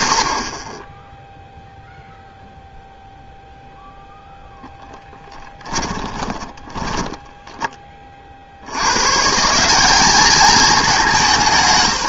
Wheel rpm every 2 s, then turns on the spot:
0, 0, 10, 10, 160, 180.
4-6